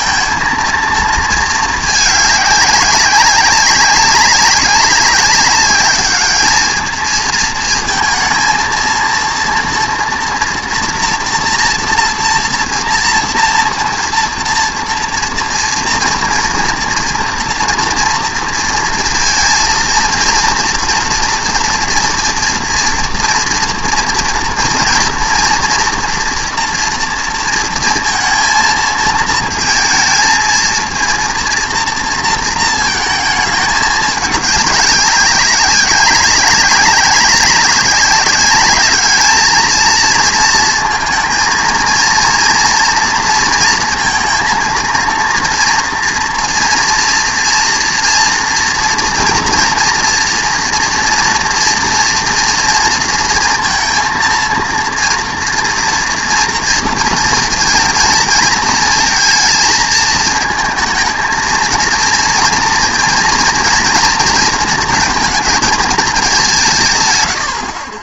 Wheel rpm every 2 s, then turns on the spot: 230, 200, 200, 210, 230, 230, 230, 230, 230, 230, 230, 240, 230, 230, 230, 220, 230, 200, 190, 200, 230, 230, 230, 230, 230, 230, 230, 230, 230, 220, 220, 230, 230, 180.
none